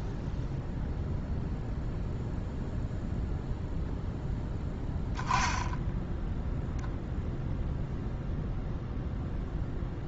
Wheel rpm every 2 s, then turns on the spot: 0, 0, 10, 0, 0.
none